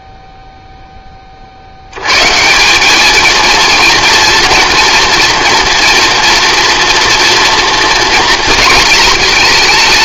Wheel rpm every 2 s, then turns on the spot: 0, 190, 230, 230, 230.
none